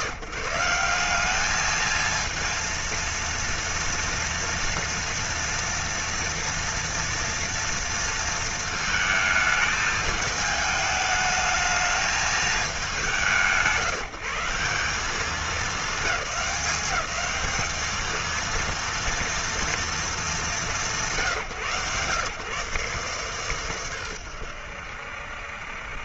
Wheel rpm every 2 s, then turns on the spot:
160, 230, 230, 230, 230, 210, 220, 160, 210, 220, 210, 130, 110.
none